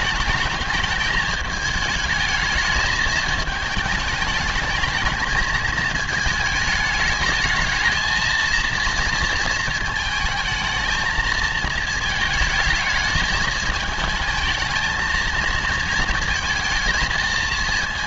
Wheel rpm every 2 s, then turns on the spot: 220, 220, 210, 210, 230, 220, 220, 220, 230.
none